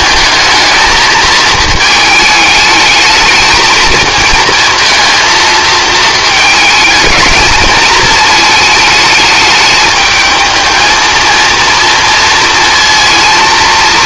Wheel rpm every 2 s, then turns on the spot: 220, 220, 220, 220, 220, 220, 230.
none